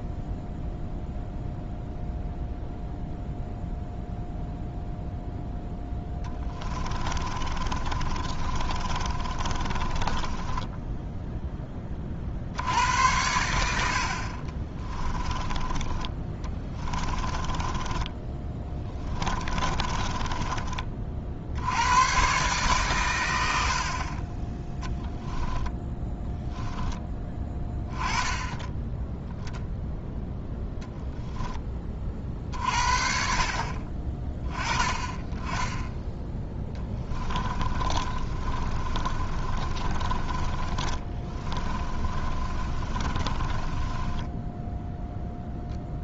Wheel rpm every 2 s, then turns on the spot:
0, 0, 0, 20, 30, 10, 70, 30, 20, 20, 30, 130, 10, 10, 10, 0, 50, 20, 10, 30, 30, 30, 10.
6-12 14-20 36-44